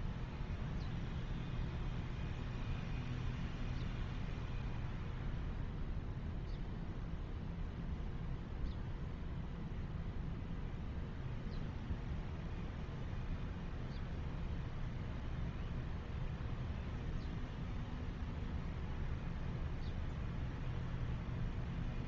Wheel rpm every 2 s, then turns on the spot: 0, 0, 0, 0, 0, 0, 0, 0, 0, 0, 0.
none